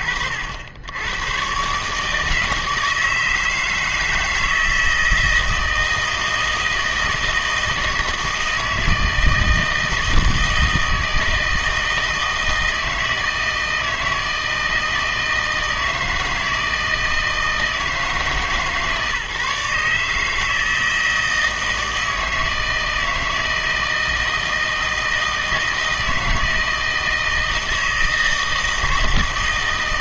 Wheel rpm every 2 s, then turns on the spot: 80, 160, 160, 160, 160, 160, 160, 160, 160, 140, 160, 160, 160, 160, 160.
none